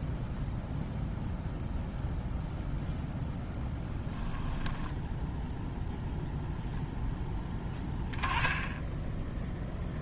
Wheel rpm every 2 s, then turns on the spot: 0, 0, 10, 0, 10.
none